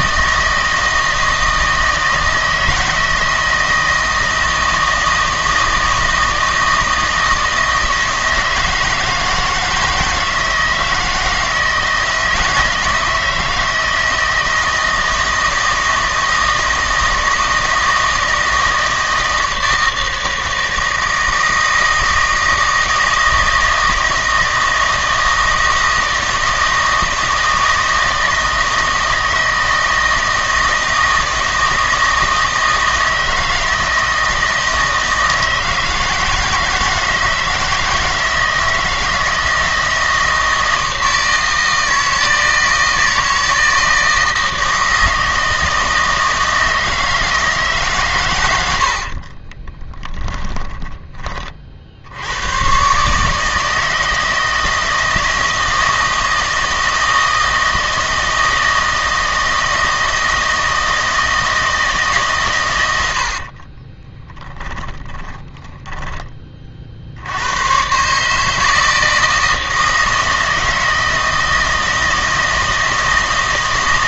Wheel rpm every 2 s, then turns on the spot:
160, 160, 160, 160, 160, 160, 160, 160, 160, 160, 160, 160, 160, 160, 160, 160, 160, 160, 160, 160, 160, 160, 160, 160, 80, 20, 110, 160, 160, 160, 160, 120, 20, 40, 160, 160, 160.
48-52 64-66